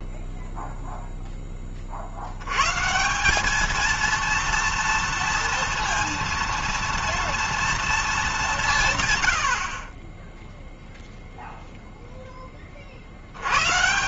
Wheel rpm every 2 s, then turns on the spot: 0, 160, 230, 230, 150, 0, 40.
none